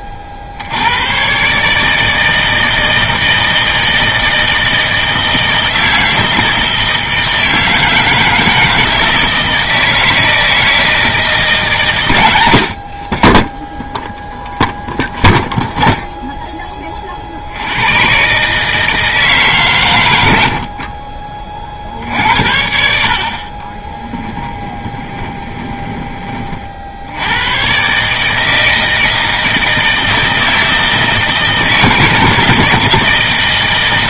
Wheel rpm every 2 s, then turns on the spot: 50, 160, 160, 160, 160, 160, 70, 0, 10, 150, 60, 70, 10, 50, 160, 160, 160.
20-22 24-26